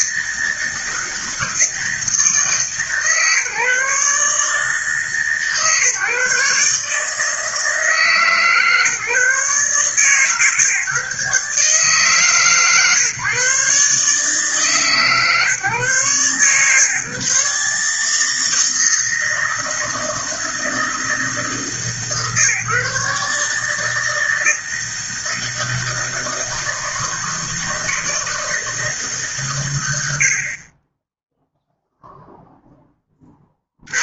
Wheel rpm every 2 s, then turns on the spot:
160, 140, 150, 150, 150, 150, 140, 140, 130, 160, 160, 150, 160, 160, 150, 20, 10.
none